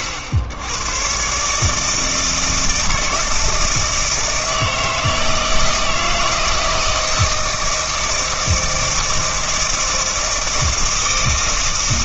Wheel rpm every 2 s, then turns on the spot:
90, 160, 160, 160, 160, 160.
none